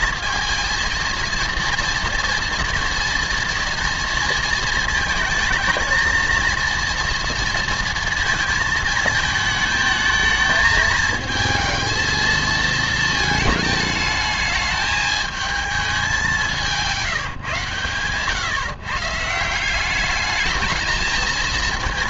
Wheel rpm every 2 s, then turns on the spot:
220, 230, 220, 230, 230, 220, 220, 210, 190, 140, 210.
none